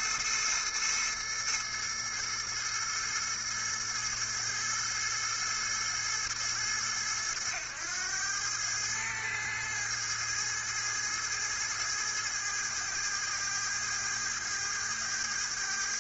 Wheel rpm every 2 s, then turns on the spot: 110, 110, 110, 90, 110, 110, 110, 110.
none